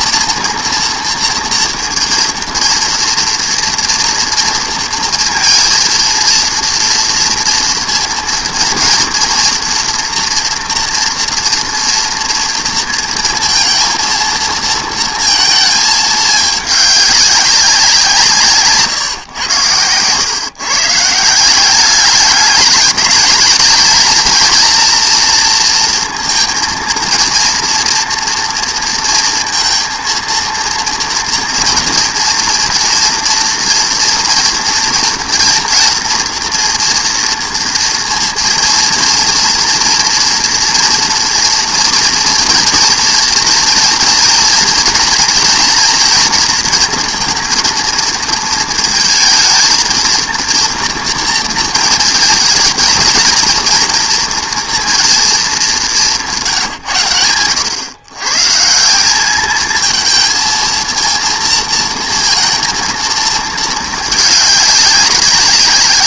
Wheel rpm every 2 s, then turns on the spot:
230, 230, 230, 230, 240, 240, 230, 230, 210, 170, 140, 200, 230, 230, 230, 230, 230, 230, 230, 230, 230, 240, 230, 230, 220, 230, 220, 230, 160, 150, 220, 230, 200.
none